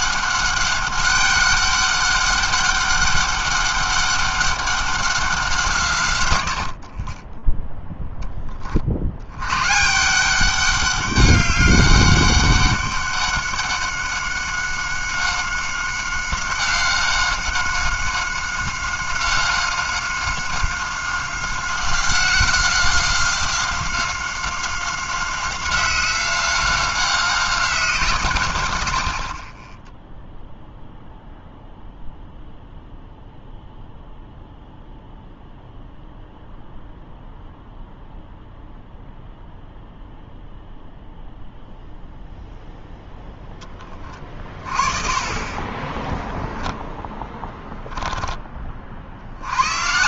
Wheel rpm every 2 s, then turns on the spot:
200, 200, 200, 80, 30, 190, 200, 190, 190, 190, 190, 180, 190, 190, 110, 0, 0, 0, 0, 0, 0, 0, 30, 10, 20.
none